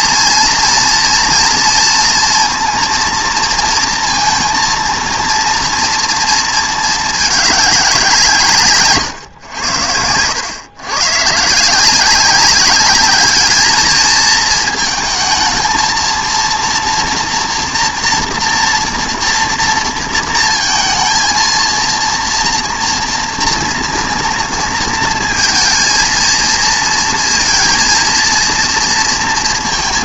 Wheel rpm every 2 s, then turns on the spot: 230, 230, 230, 220, 140, 130, 210, 230, 230, 230, 230, 230, 230, 230, 230.
8-10